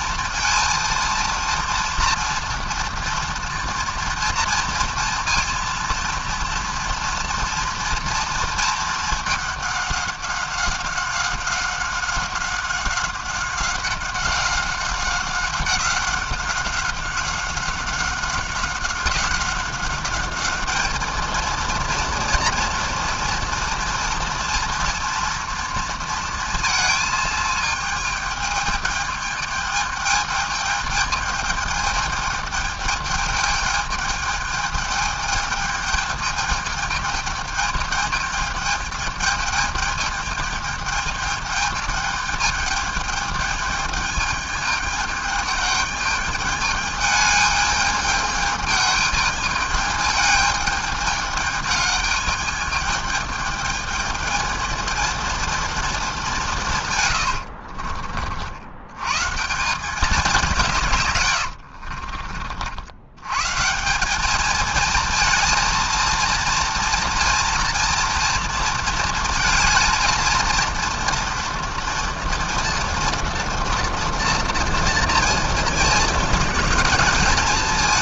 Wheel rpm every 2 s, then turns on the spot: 230, 230, 230, 240, 220, 190, 190, 190, 190, 190, 210, 230, 230, 230, 210, 210, 210, 210, 210, 210, 210, 210, 210, 210, 210, 210, 210, 220, 140, 110, 140, 80, 220, 230, 230, 230, 230, 230, 210.
56-58